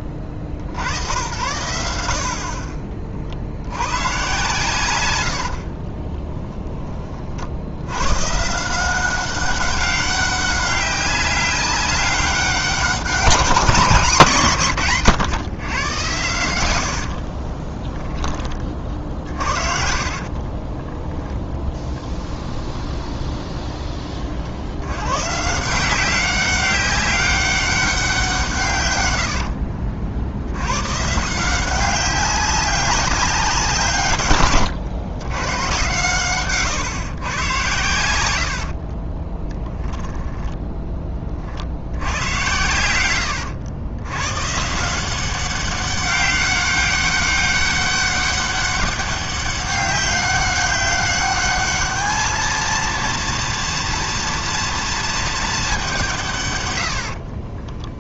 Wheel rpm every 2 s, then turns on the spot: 50, 40, 120, 20, 170, 200, 190, 140, 90, 30, 30, 20, 90, 190, 140, 110, 200, 130, 140, 60, 10, 110, 160, 200, 200, 200, 230, 230, 110.
16-18 20-24 38-40